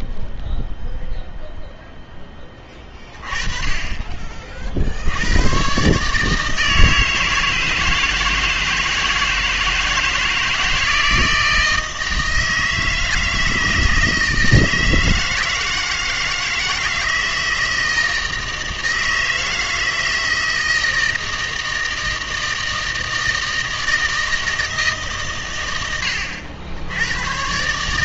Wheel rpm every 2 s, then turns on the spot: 0, 20, 60, 160, 160, 160, 160, 160, 160, 160, 160, 160, 150, 80.
none